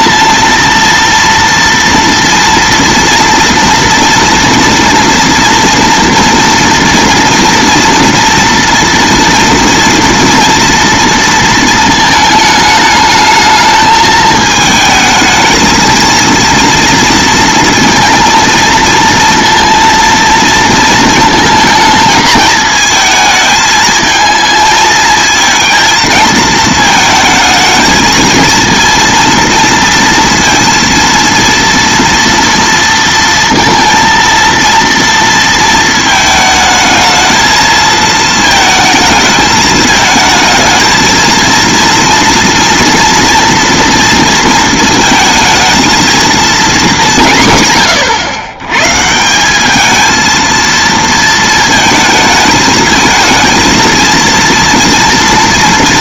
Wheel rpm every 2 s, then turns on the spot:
230, 230, 230, 230, 230, 230, 210, 220, 230, 230, 230, 220, 220, 220, 230, 230, 230, 230, 220, 220, 220, 230, 230, 230, 130, 230, 220, 230.
none